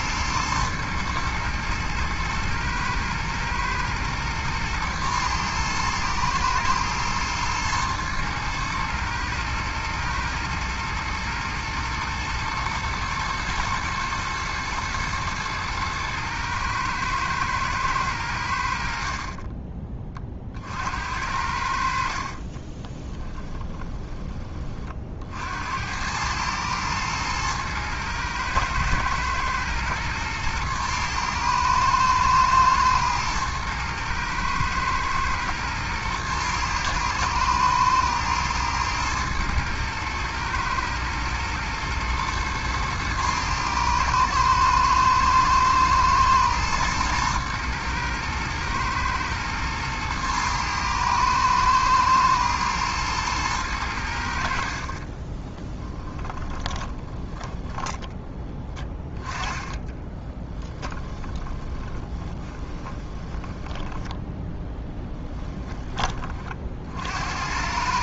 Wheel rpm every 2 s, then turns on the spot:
110, 110, 110, 110, 110, 110, 120, 110, 110, 50, 60, 20, 40, 110, 110, 110, 120, 120, 110, 110, 110, 110, 110, 110, 110, 110, 110, 40, 20, 10, 20, 20, 10, 50.
22-24 54-58 60-66